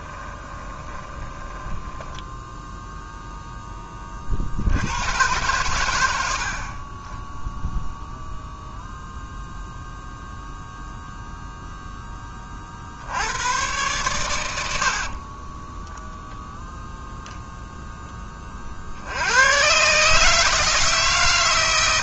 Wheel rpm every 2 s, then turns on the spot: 20, 0, 90, 40, 0, 0, 50, 70, 0, 40, 150.
0-2 6-8 14-16